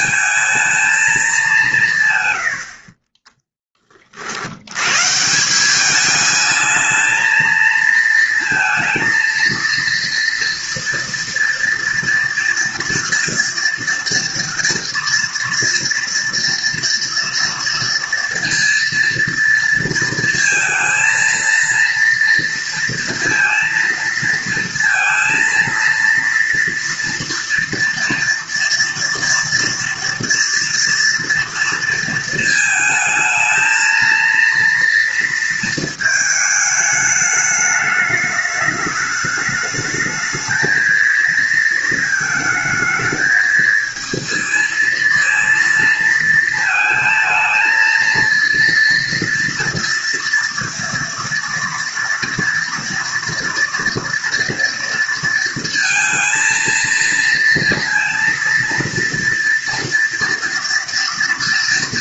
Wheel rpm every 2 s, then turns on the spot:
210, 30, 130, 220, 230, 230, 240, 230, 230, 230, 220, 230, 230, 230, 230, 230, 220, 230, 210, 210, 220, 220, 230, 220, 230, 230, 230, 230, 230, 230, 230.
none